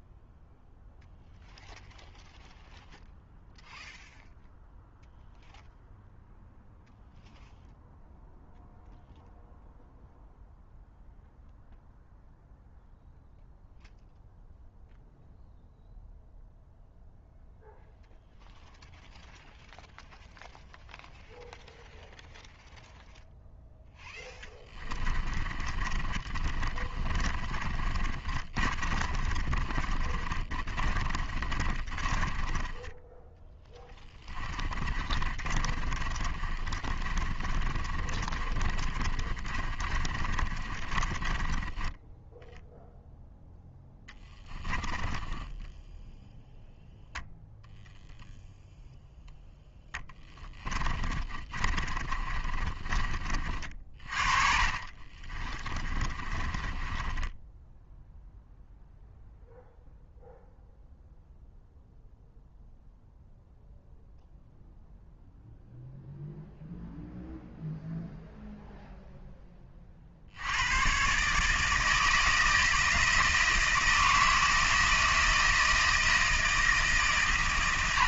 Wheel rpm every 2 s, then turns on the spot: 0, 0, 0, 0, 0, 0, 0, 0, 0, 0, 0, 0, 20, 30, 30, 30, 10, 20, 30, 30, 30, 0, 10, 0, 0, 20, 30, 40, 20, 0, 0, 0, 0, 0, 0, 110, 160, 160, 160.
24-42 44-46 50-52 54-58